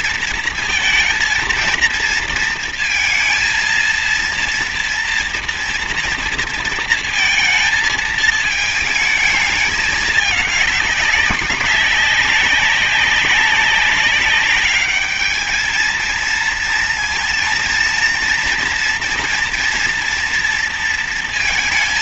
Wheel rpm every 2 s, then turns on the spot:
230, 230, 240, 230, 220, 210, 190, 200, 230, 230, 230.
none